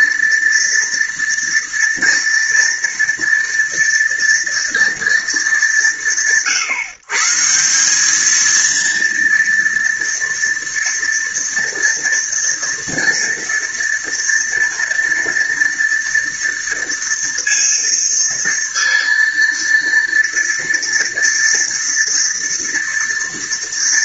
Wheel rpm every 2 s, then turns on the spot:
230, 230, 230, 160, 230, 230, 230, 230, 230, 230, 230, 230.
none